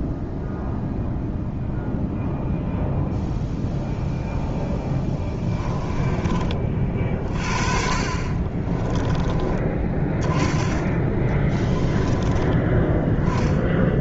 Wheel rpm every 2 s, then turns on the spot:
0, 0, 10, 40, 20, 20, 10.
4-6 8-12